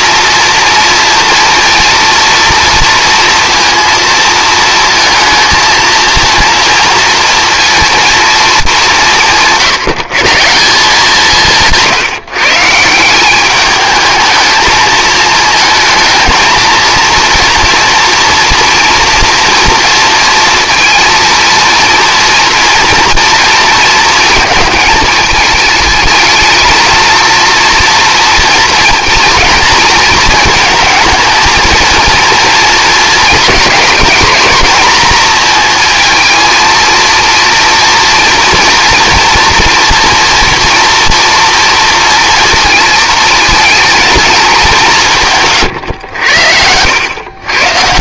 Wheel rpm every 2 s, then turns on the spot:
230, 230, 230, 230, 210, 170, 160, 220, 230, 230, 230, 230, 220, 220, 230, 220, 230, 220, 230, 230, 240, 230, 200, 80.
none